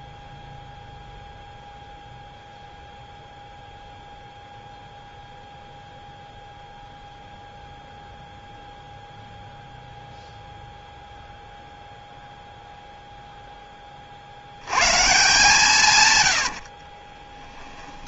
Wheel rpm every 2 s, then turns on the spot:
0, 0, 0, 0, 0, 0, 0, 80, 80.
16-18